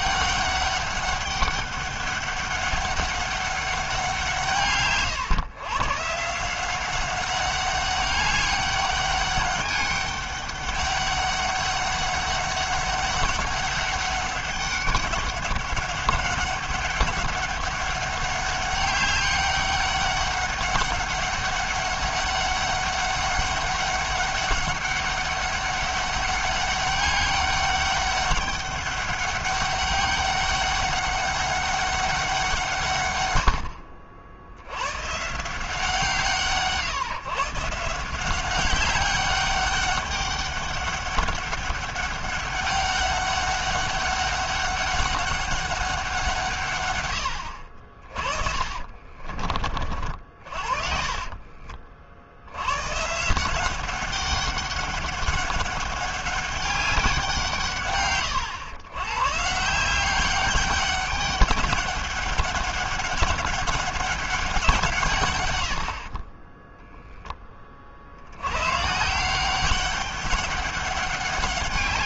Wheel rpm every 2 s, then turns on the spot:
200, 200, 160, 180, 200, 200, 200, 200, 200, 200, 200, 200, 200, 200, 200, 200, 160, 100, 160, 190, 200, 200, 200, 140, 20, 50, 100, 190, 200, 120, 200, 200, 170, 10, 120, 200.
48-52